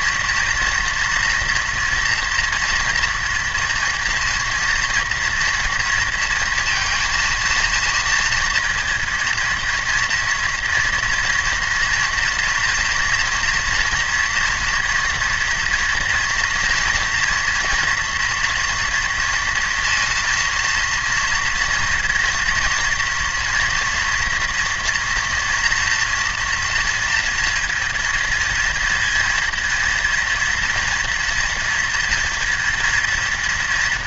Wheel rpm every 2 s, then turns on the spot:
230, 230, 230, 230, 230, 230, 240, 230, 230, 230, 230, 230, 230, 230, 230, 240, 240.
none